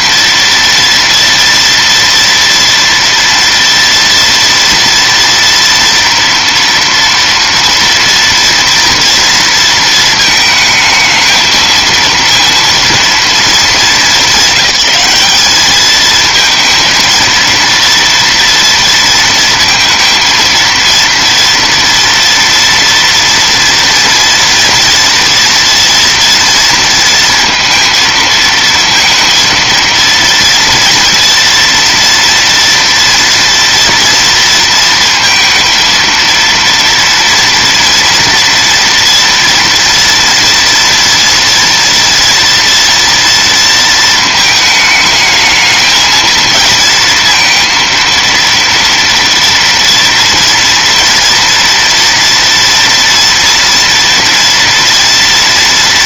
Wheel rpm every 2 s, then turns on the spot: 230, 230, 230, 230, 230, 230, 220, 210, 230, 230, 230, 230, 230, 230, 230, 240, 230, 230, 240, 230, 240, 230, 220, 230, 230, 230, 230, 240.
none